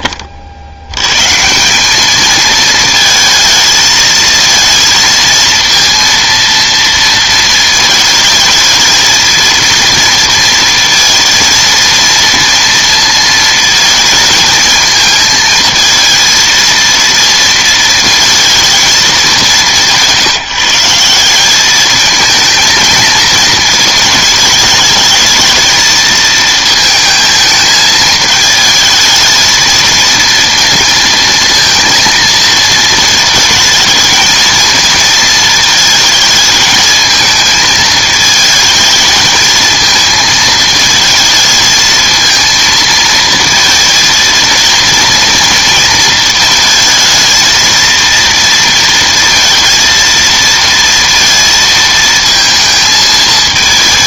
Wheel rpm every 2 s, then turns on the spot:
70, 220, 230, 230, 220, 230, 230, 220, 230, 220, 170, 230, 220, 220, 220, 230, 230, 230, 220, 220, 220, 220, 230, 220, 230, 230, 220.
none